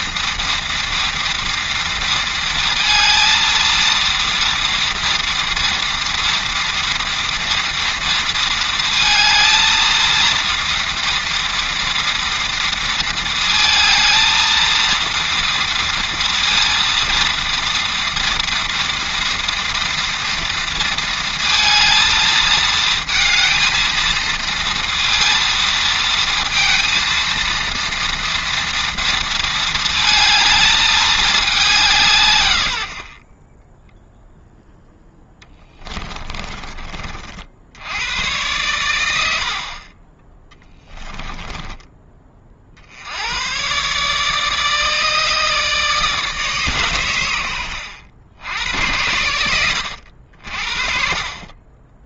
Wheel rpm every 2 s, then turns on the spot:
230, 230, 230, 230, 230, 230, 230, 230, 230, 230, 230, 220, 230, 230, 230, 210, 60, 10, 40, 100, 10, 80, 150, 120, 90, 50.
40-42